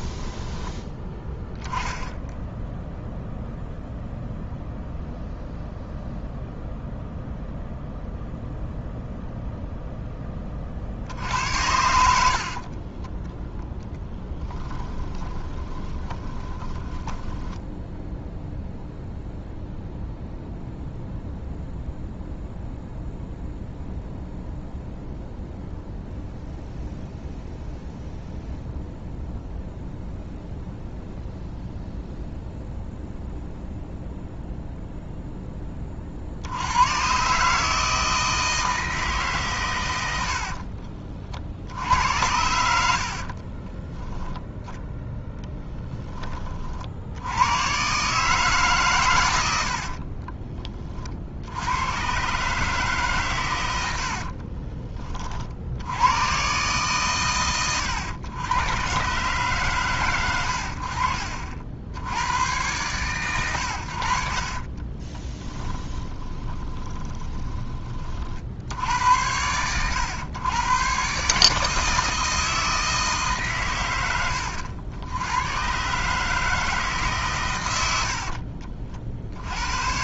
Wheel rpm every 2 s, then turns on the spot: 10, 0, 0, 0, 0, 40, 40, 20, 20, 0, 0, 0, 0, 0, 0, 0, 0, 0, 90, 160, 60, 80, 0, 40, 140, 20, 150, 30, 130, 110, 80, 110, 30, 20, 70, 120, 160, 90, 160, 50.
12-18 40-42 54-56 64-68